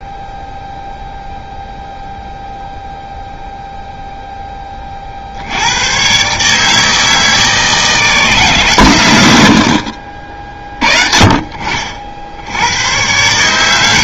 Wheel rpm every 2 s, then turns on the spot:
0, 0, 20, 150, 140, 30, 80.
none